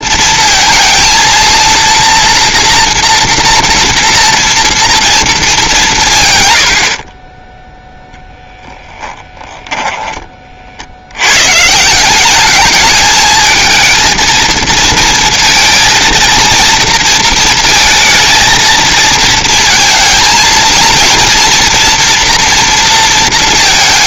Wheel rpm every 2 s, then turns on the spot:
230, 230, 240, 80, 0, 40, 210, 220, 230, 230, 230, 230.
6-8